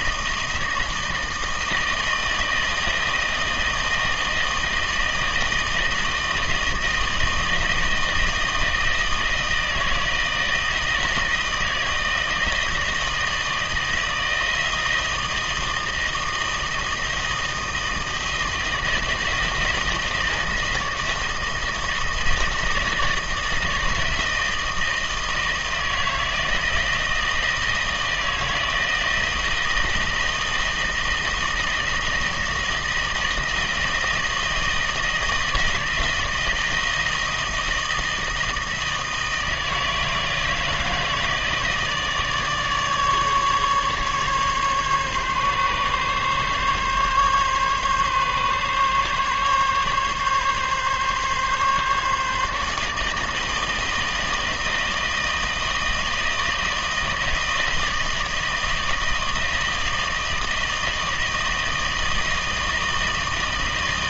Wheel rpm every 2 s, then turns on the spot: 160, 160, 160, 160, 160, 160, 160, 160, 160, 160, 160, 160, 160, 160, 160, 160, 160, 160, 160, 160, 160, 150, 140, 140, 140, 140, 150, 160, 160, 160, 160, 160.
none